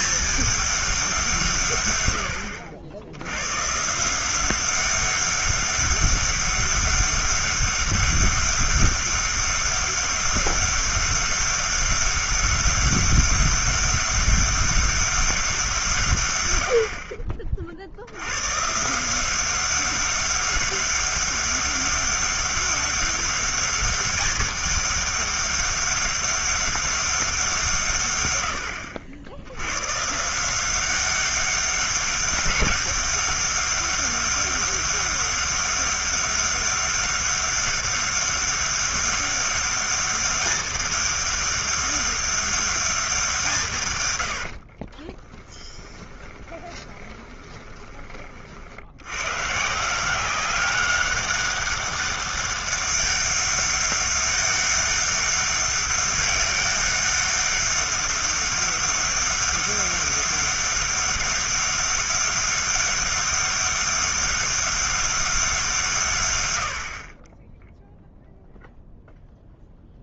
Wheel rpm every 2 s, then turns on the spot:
210, 90, 190, 200, 200, 200, 200, 200, 80, 140, 200, 200, 200, 200, 70, 180, 200, 200, 200, 200, 200, 200, 50, 20, 60, 190, 200, 200, 200, 200, 200, 200, 200, 70, 0.
44-48